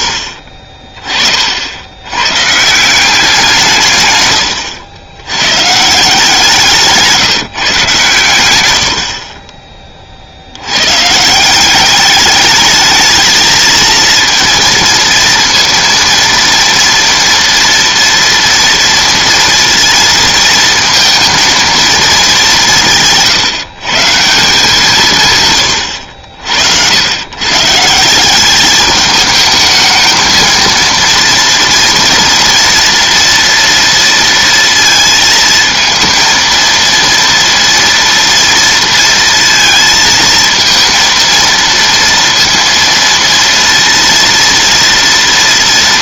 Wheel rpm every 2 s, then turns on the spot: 40, 150, 110, 170, 100, 90, 210, 230, 230, 230, 230, 190, 160, 70, 200, 230, 230, 230, 230, 230, 230, 230, 230.
none